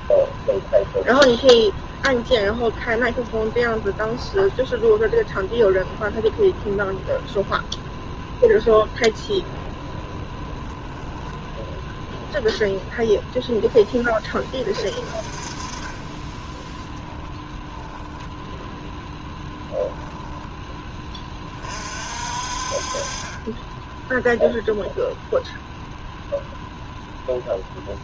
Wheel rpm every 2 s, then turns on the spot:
0, 0, 0, 0, 0, 0, 0, 30, 10, 0, 10, 30, 0, 0.
16-18